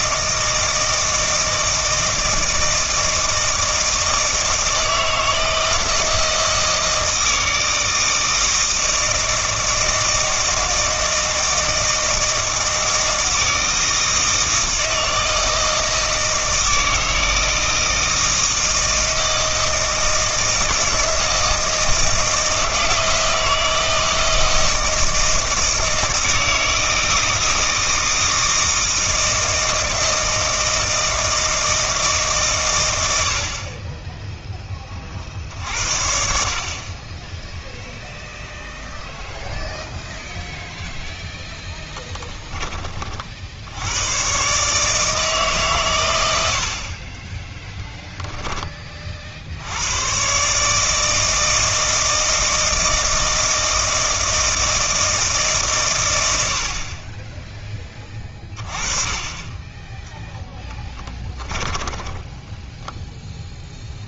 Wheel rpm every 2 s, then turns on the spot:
160, 160, 160, 160, 160, 160, 160, 160, 160, 160, 160, 160, 160, 160, 160, 160, 100, 30, 20, 0, 0, 20, 150, 40, 30, 160, 160, 160, 40, 20, 10, 0.
60-62